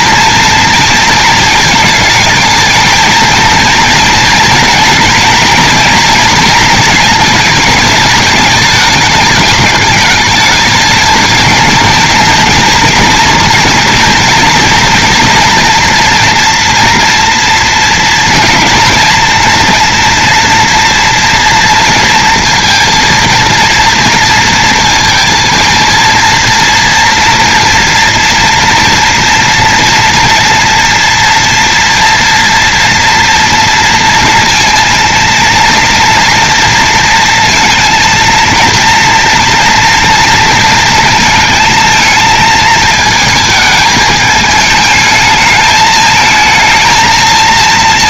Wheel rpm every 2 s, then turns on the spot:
230, 220, 230, 230, 210, 220, 230, 230, 240, 230, 230, 230, 230, 230, 230, 230, 240, 230, 230, 230, 230, 220, 220, 220.
none